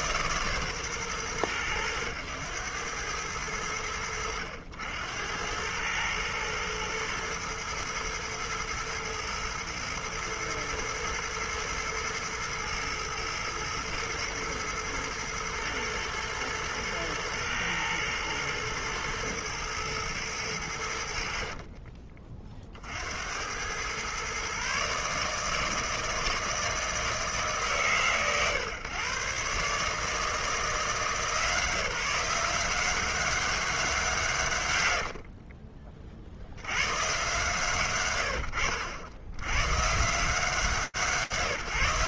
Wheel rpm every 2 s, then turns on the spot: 140, 100, 80, 120, 120, 110, 110, 110, 110, 110, 100, 40, 130, 160, 120, 150, 170, 140, 80, 70, 160.
none